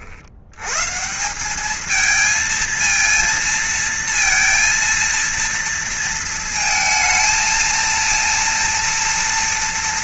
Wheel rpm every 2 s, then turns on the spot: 130, 220, 230, 230, 230.
none